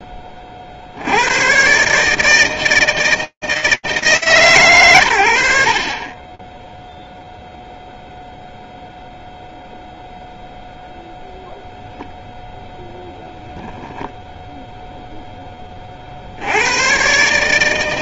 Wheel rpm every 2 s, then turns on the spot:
40, 160, 110, 0, 0, 0, 0, 10, 140.
none